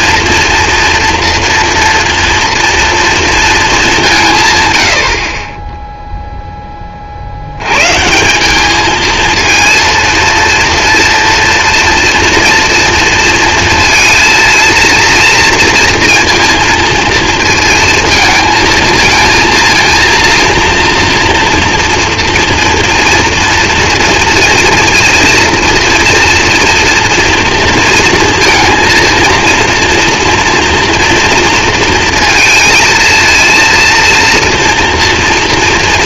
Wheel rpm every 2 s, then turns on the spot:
230, 230, 130, 10, 200, 230, 230, 230, 230, 220, 230, 230, 230, 230, 230, 230, 220, 230.
none